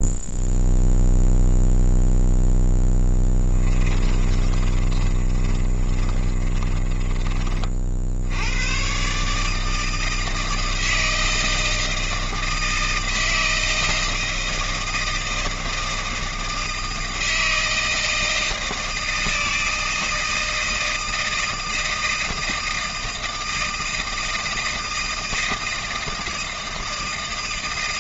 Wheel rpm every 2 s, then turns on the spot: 0, 10, 30, 20, 110, 160, 160, 160, 160, 160, 160, 160, 160, 160.
4-8